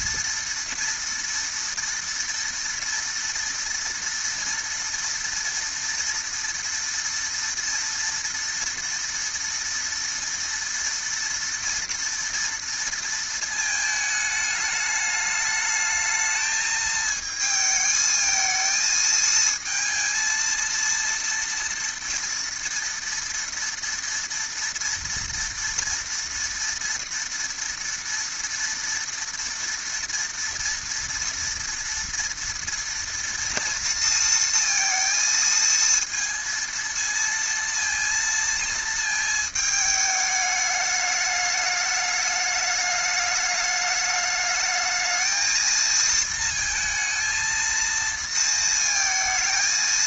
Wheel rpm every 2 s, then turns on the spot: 230, 230, 230, 240, 230, 230, 230, 210, 220, 220, 230, 230, 230, 230, 230, 230, 230, 230, 230, 230, 210, 210, 210, 220, 230.
none